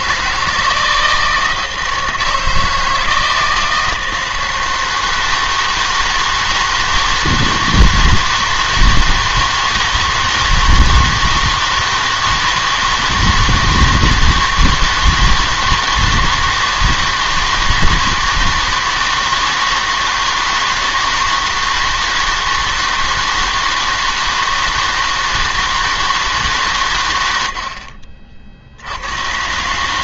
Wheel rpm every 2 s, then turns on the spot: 160, 160, 160, 160, 160, 160, 160, 160, 160, 160, 160, 160, 160, 140, 70.
none